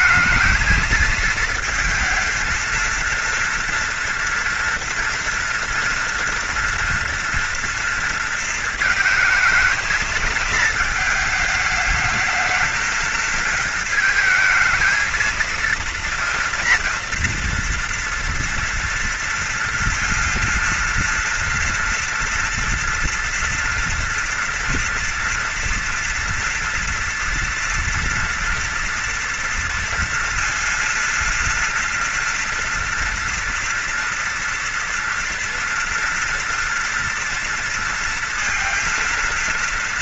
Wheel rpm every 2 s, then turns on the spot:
220, 230, 230, 230, 230, 220, 220, 230, 240, 230, 230, 240, 230, 230, 230, 240, 230, 230, 230, 230.
none